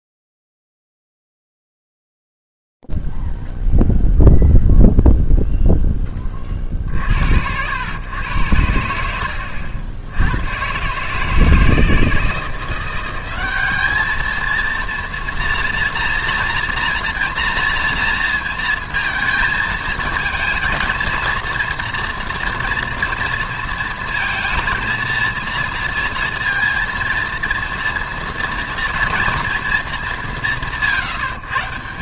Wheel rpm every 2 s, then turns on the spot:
0, 0, 0, 20, 110, 90, 160, 220, 240, 230, 220, 230, 230, 230, 230, 180.
none